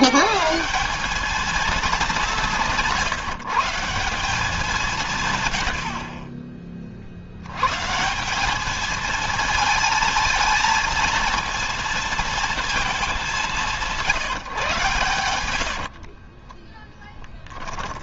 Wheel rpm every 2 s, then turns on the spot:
180, 180, 180, 40, 220, 220, 220, 120, 10.
16-18